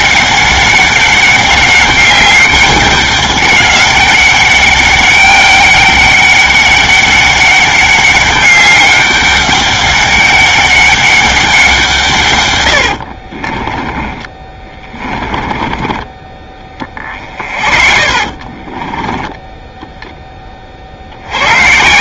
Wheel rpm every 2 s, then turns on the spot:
200, 200, 200, 200, 200, 200, 110, 20, 30, 20, 30.
14-16 18-20